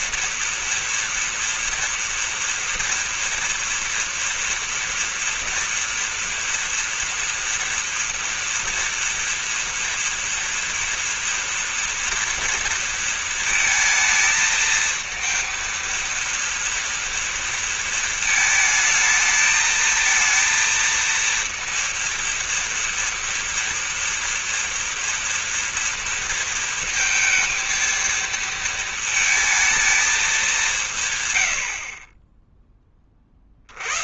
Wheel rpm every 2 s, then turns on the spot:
230, 230, 230, 230, 230, 230, 230, 220, 230, 220, 230, 230, 230, 230, 230, 170, 20.
none